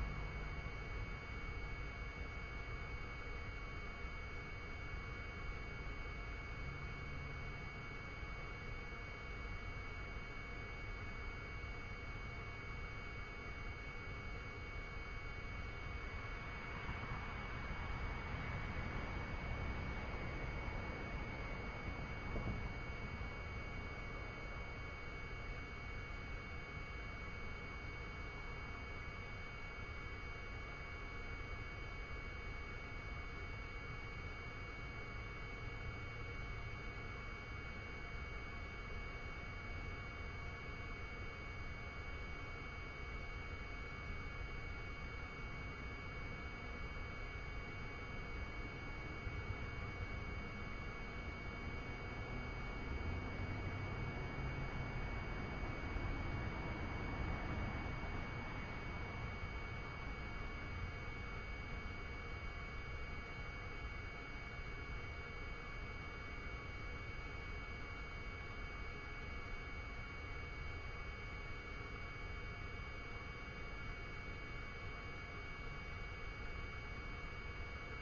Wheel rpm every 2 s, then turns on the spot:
0, 0, 0, 0, 0, 0, 0, 0, 0, 0, 0, 0, 0, 0, 0, 0, 0, 0, 0, 0, 0, 0, 0, 0, 0, 0, 0, 0, 0, 0, 0, 0, 0, 0, 0, 0, 0, 0, 0.
none